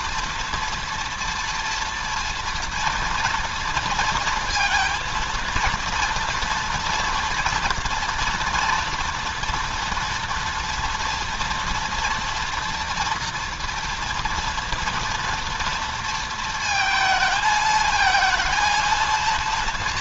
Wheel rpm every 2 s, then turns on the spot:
230, 230, 230, 230, 240, 230, 240, 230, 220, 220.
none